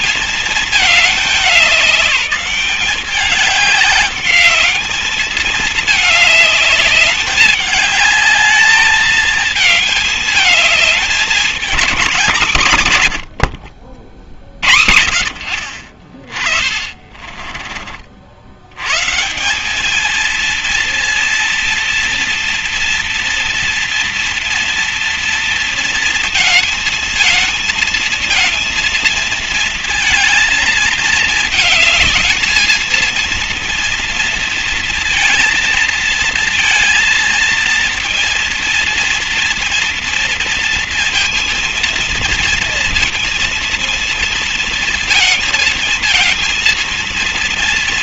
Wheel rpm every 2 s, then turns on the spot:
220, 200, 210, 210, 210, 220, 160, 30, 30, 60, 210, 230, 230, 230, 220, 230, 220, 230, 220, 230, 230, 230, 230, 230.
16-18